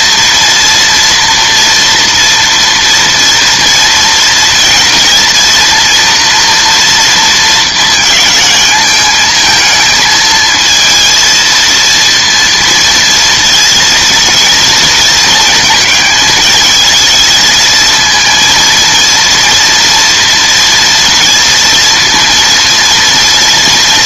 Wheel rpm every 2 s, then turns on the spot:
230, 230, 230, 230, 210, 220, 230, 230, 220, 230, 230, 230.
none